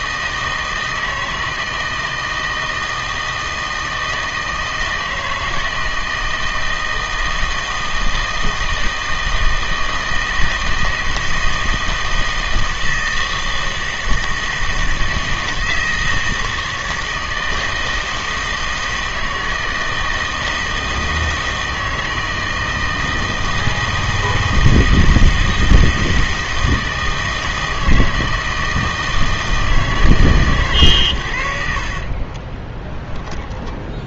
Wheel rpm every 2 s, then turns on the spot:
160, 160, 160, 160, 160, 160, 160, 160, 160, 160, 160, 160, 160, 160, 160, 120, 10.
32-34